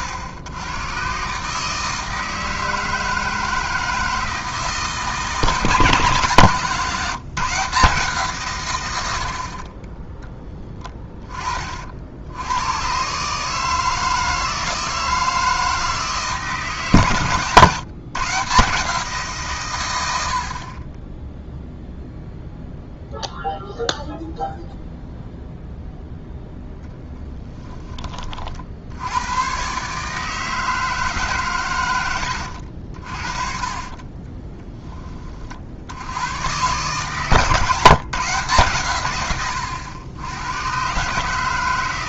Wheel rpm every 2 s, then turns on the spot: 100, 160, 160, 140, 120, 20, 110, 160, 150, 150, 40, 0, 0, 0, 60, 160, 70, 20, 130, 130, 120.
10-12 34-36